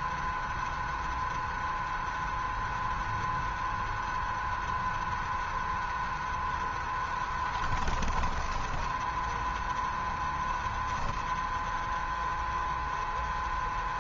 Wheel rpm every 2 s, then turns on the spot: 0, 0, 0, 10, 10, 0, 0.
none